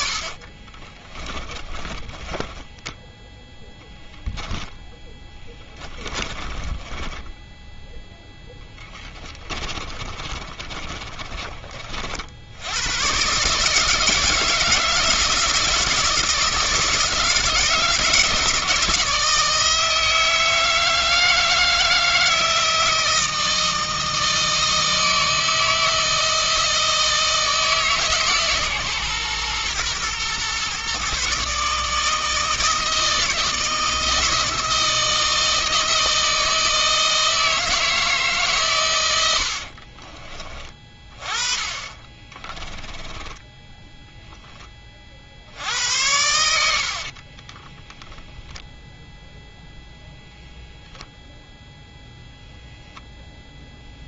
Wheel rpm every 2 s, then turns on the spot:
20, 10, 10, 20, 20, 30, 110, 160, 160, 160, 160, 160, 160, 160, 130, 130, 160, 160, 160, 120, 30, 20, 30, 60, 0, 0, 0.
0-4 6-12 42-44 46-48